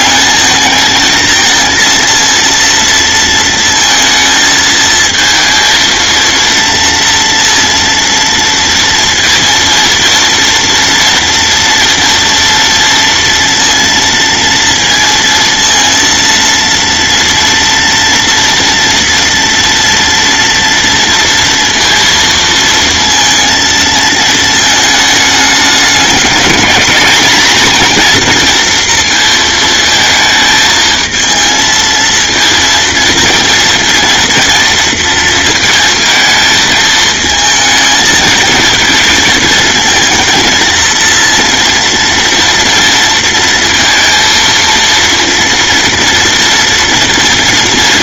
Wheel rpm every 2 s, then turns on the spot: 220, 230, 230, 230, 230, 240, 230, 230, 230, 230, 230, 230, 220, 210, 230, 220, 230, 230, 220, 220, 230, 230, 230, 230.
none